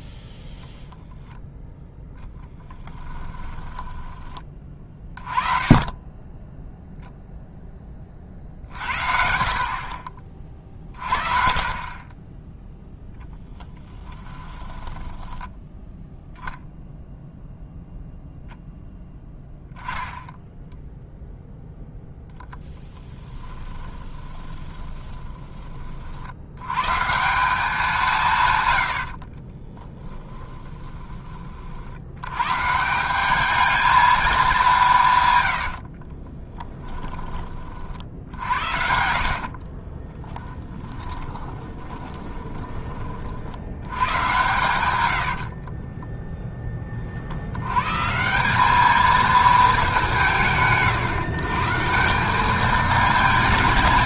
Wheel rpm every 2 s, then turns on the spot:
0, 10, 20, 10, 60, 40, 0, 20, 0, 0, 0, 10, 20, 100, 110, 10, 150, 190, 10, 70, 10, 20, 100, 20, 200, 130, 210.
2-4 14-16 22-26 30-32 36-42